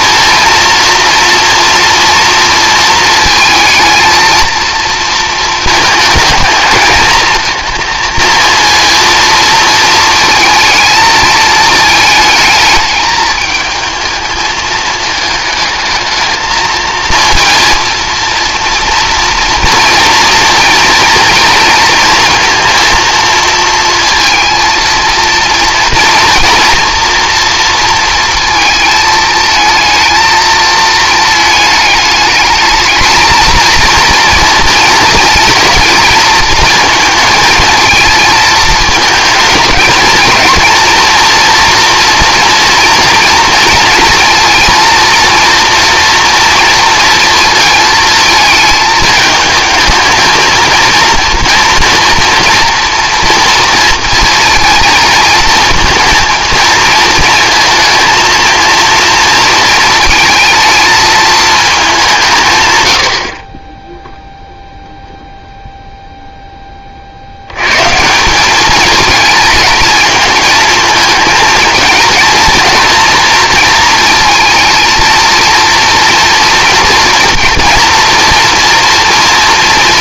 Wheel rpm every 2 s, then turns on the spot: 230, 230, 230, 220, 230, 220, 220, 220, 220, 230, 230, 230, 230, 230, 230, 220, 220, 220, 220, 220, 230, 240, 230, 230, 220, 230, 240, 230, 220, 230, 220, 110, 0, 20, 210, 220, 230, 220, 230, 230.
none